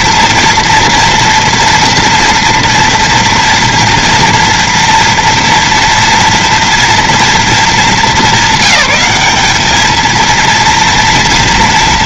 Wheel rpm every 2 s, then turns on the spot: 230, 230, 240, 230, 200, 230.
none